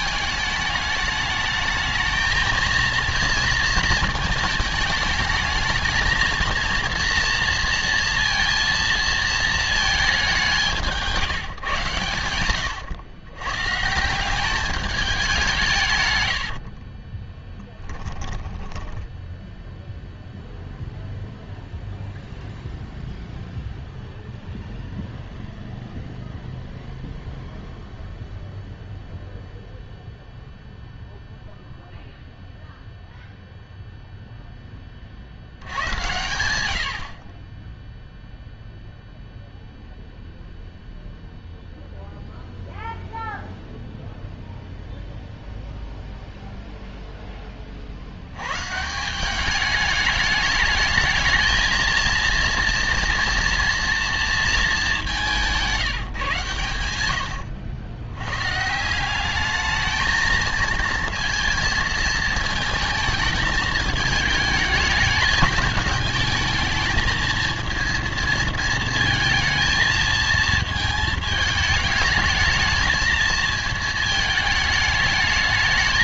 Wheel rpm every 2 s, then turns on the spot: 210, 230, 220, 230, 230, 180, 110, 200, 60, 10, 0, 0, 0, 0, 0, 0, 0, 10, 90, 0, 0, 0, 0, 0, 130, 210, 230, 220, 110, 150, 220, 220, 220, 220, 220, 220, 220, 220.
12-14 16-20